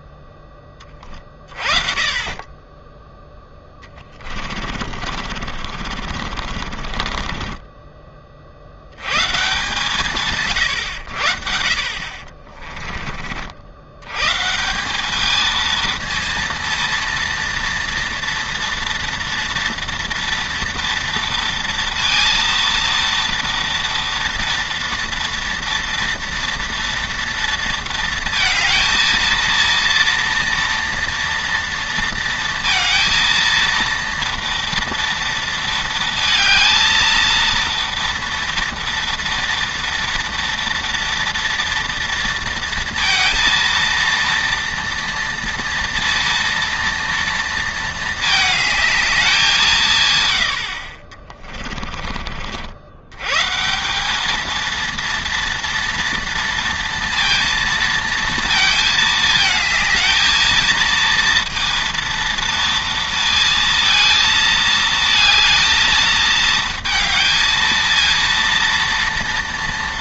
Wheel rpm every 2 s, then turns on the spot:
20, 10, 50, 40, 60, 130, 30, 150, 230, 240, 230, 230, 230, 230, 230, 230, 230, 230, 220, 230, 230, 230, 230, 230, 220, 80, 50, 220, 230, 220, 230, 230, 220, 220, 230.
4-8 12-14